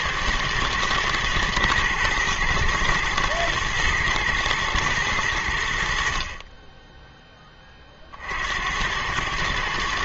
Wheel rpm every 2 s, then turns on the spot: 110, 110, 110, 20, 80.
none